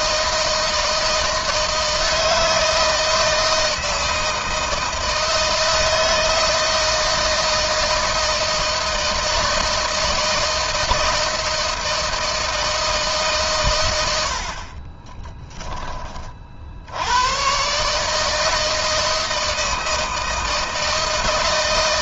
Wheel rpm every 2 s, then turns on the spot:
160, 160, 160, 160, 160, 160, 160, 30, 80, 160, 160.
14-16